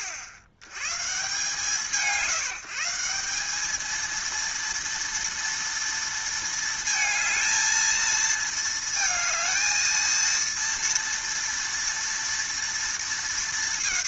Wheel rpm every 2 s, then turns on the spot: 100, 190, 230, 220, 220, 230, 230.
none